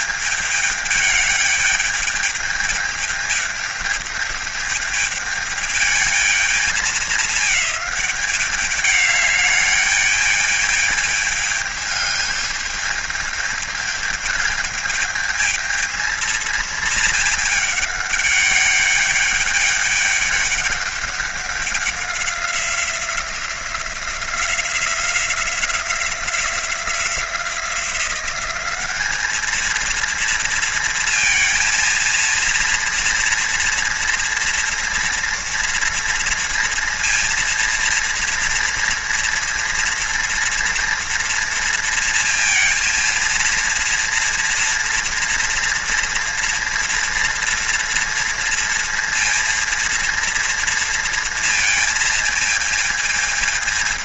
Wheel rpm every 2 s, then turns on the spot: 210, 210, 210, 210, 200, 210, 210, 220, 220, 210, 200, 190, 180, 180, 200, 230, 230, 230, 230, 230, 230, 230, 230, 230, 230, 230, 220.
none